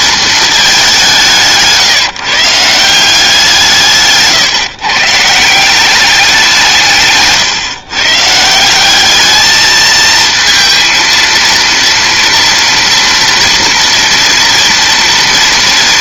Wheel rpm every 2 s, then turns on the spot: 180, 170, 130, 150, 200, 230, 230, 230.
none